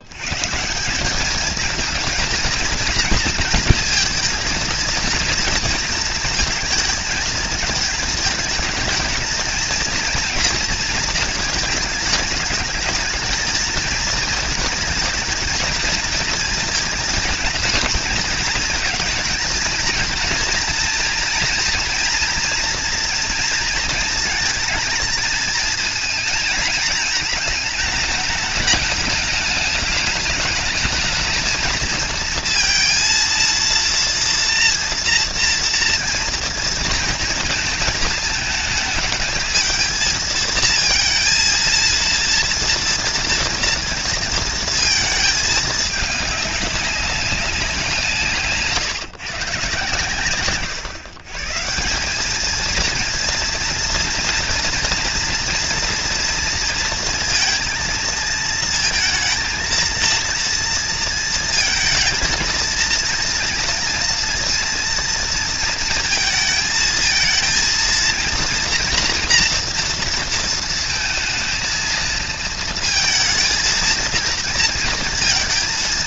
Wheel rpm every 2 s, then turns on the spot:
130, 230, 230, 220, 220, 230, 210, 220, 230, 230, 230, 240, 230, 220, 210, 210, 230, 230, 230, 220, 220, 230, 230, 200, 160, 130, 210, 240, 230, 230, 230, 220, 230, 230, 230, 230, 220, 230.
none